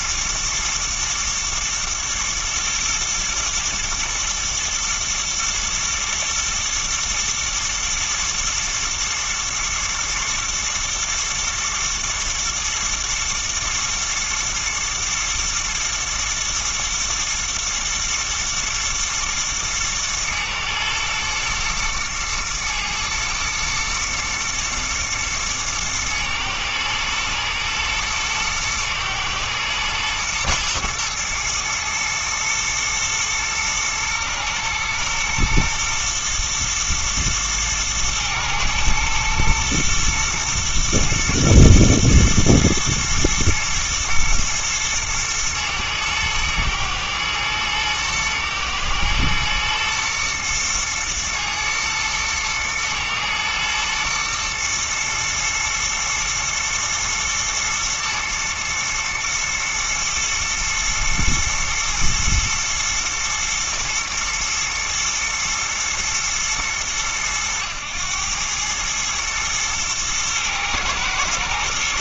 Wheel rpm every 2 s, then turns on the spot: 120, 120, 110, 110, 120, 120, 120, 120, 110, 120, 110, 110, 110, 110, 120, 110, 110, 120, 110, 110, 120, 110, 110, 110, 110, 110, 110, 120, 120, 120, 110, 120, 110, 100, 100, 110.
none